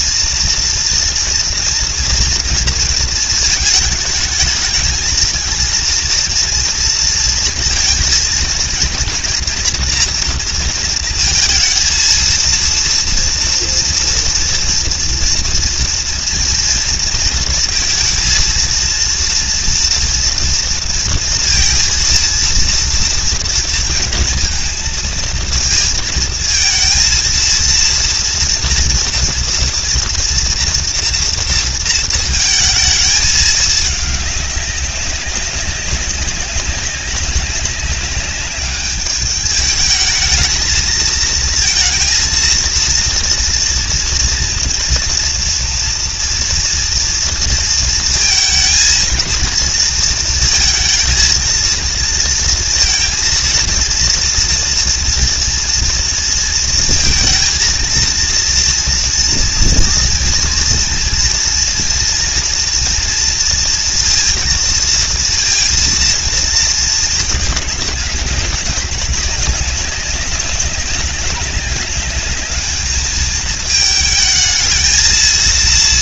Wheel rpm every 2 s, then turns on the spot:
240, 230, 220, 230, 230, 230, 230, 230, 230, 230, 230, 230, 230, 230, 230, 230, 220, 200, 190, 200, 220, 230, 230, 240, 230, 230, 230, 230, 230, 230, 230, 230, 230, 230, 200, 200, 210, 220.
none